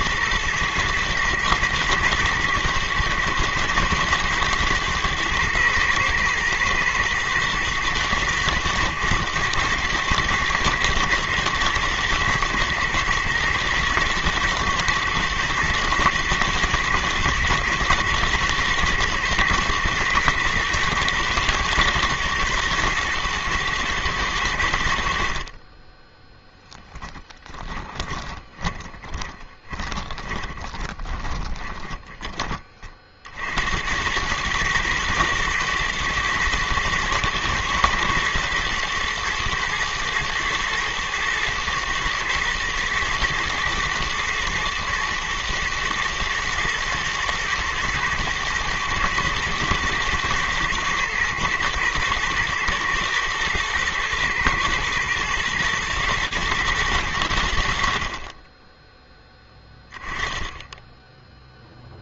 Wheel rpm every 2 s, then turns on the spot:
110, 110, 110, 120, 110, 120, 120, 120, 110, 110, 110, 110, 80, 0, 10, 20, 40, 110, 110, 120, 110, 110, 110, 110, 110, 110, 120, 120, 110, 10, 10.
28-32